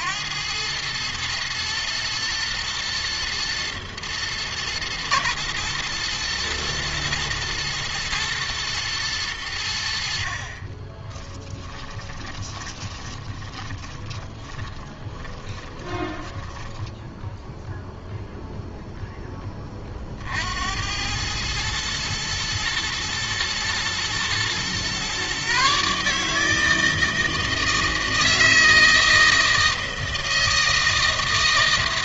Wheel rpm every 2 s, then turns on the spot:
100, 110, 110, 110, 110, 30, 20, 30, 10, 0, 70, 110, 120, 160, 160, 160.
10-18